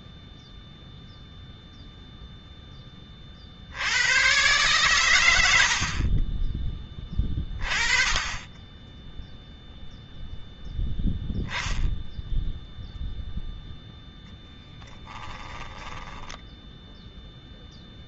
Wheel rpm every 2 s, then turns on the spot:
0, 10, 120, 20, 10, 10, 10, 0, 10.
16-18